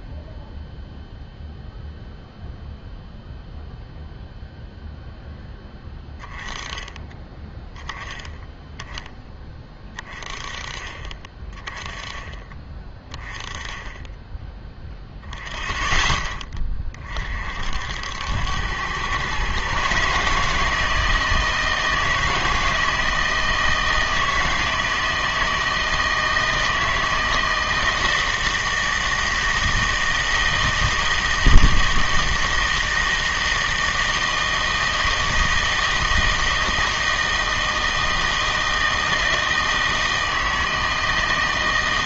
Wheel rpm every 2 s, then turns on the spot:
0, 0, 0, 10, 10, 20, 20, 10, 20, 100, 160, 160, 160, 160, 160, 160, 160, 160, 160, 160, 160.
none